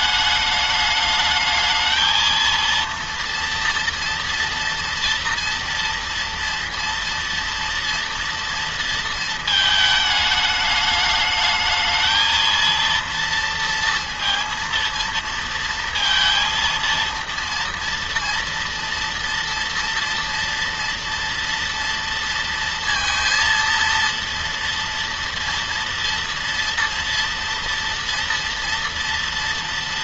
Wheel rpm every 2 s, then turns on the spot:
210, 230, 230, 230, 230, 210, 230, 230, 230, 230, 230, 230, 230, 230, 230.
none